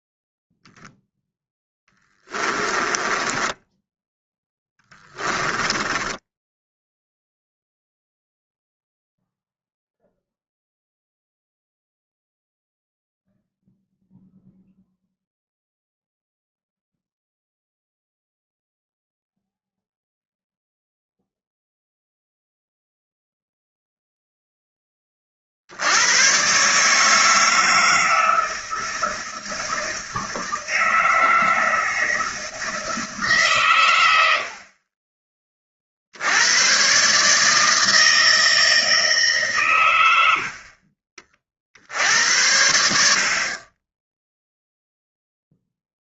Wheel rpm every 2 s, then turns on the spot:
0, 20, 10, 0, 0, 0, 0, 0, 0, 0, 0, 0, 10, 140, 160, 160, 160, 40, 120, 160, 50, 80, 0.
2-6